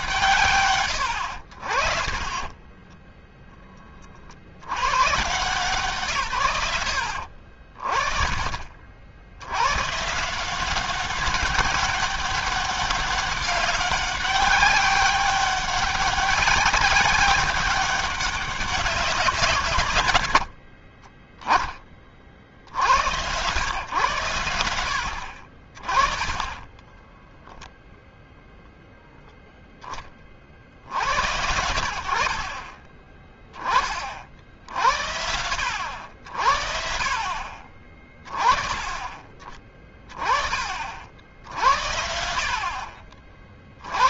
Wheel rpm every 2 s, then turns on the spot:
90, 20, 150, 50, 100, 190, 200, 190, 190, 140, 10, 100, 50, 0, 0, 70, 30, 80, 70, 30, 60, 20.
none